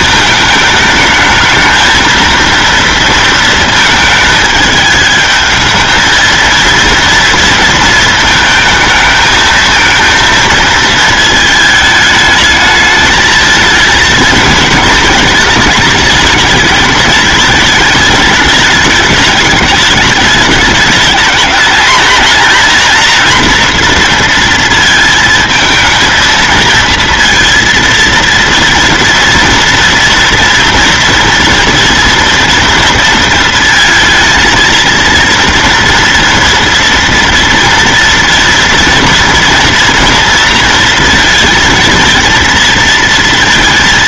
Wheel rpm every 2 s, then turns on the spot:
210, 230, 220, 230, 220, 220, 220, 220, 210, 210, 210, 240, 230, 230, 230, 230, 230, 230, 240, 230, 230, 230.
none